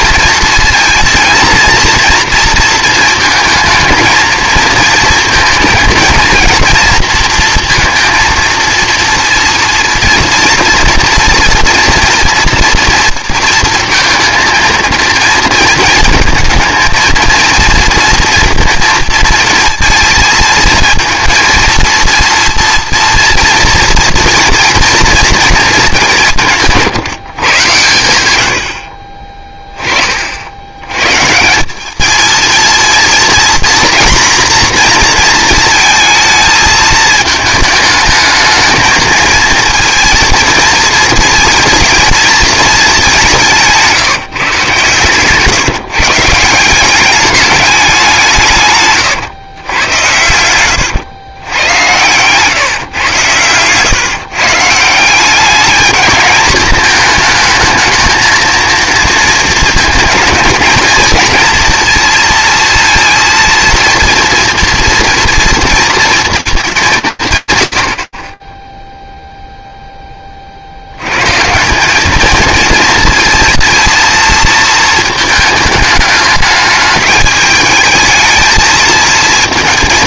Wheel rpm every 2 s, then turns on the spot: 230, 230, 220, 230, 230, 230, 230, 230, 220, 230, 220, 230, 230, 160, 70, 90, 230, 240, 220, 220, 230, 210, 130, 180, 140, 100, 130, 160, 210, 230, 220, 230, 240, 220, 20, 70, 220, 220, 210, 220.
none